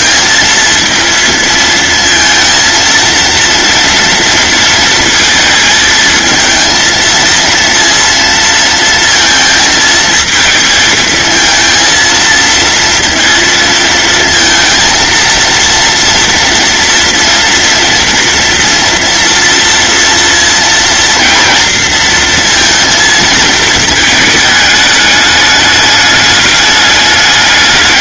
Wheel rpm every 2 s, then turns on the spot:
230, 230, 230, 230, 230, 220, 230, 230, 230, 230, 230, 220, 210, 210.
none